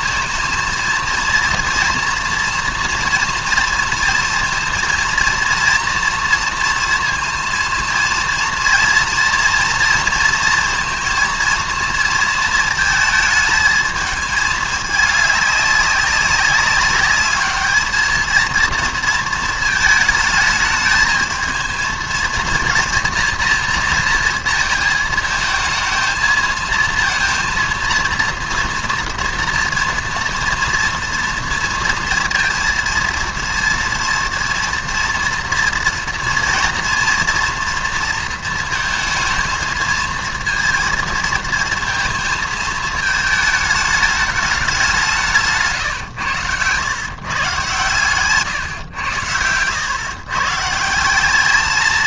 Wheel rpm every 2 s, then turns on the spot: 220, 230, 230, 230, 230, 230, 230, 220, 200, 220, 230, 220, 230, 220, 230, 230, 230, 230, 240, 230, 230, 220, 210, 110, 130, 120.
46-48